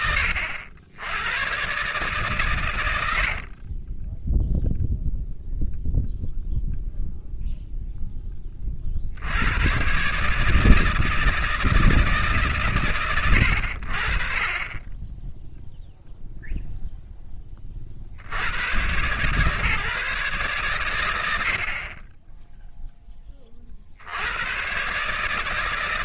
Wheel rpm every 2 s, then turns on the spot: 80, 100, 0, 0, 50, 160, 100, 30, 0, 110, 120, 10, 100.
none